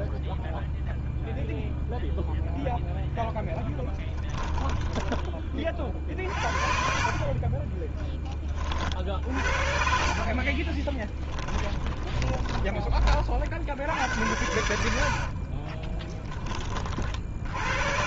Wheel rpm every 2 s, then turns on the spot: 0, 0, 20, 50, 50, 20, 30, 80, 30.
4-8 10-12 14-16